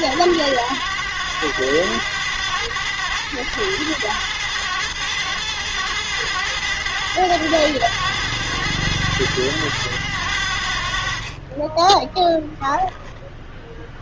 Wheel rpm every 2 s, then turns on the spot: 90, 100, 110, 100, 110, 80, 0.
none